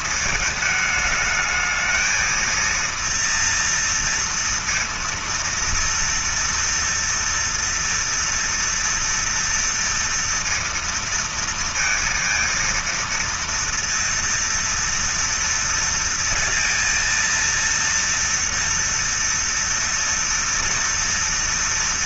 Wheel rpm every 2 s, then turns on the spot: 220, 220, 230, 230, 230, 230, 230, 230, 230, 230, 230.
none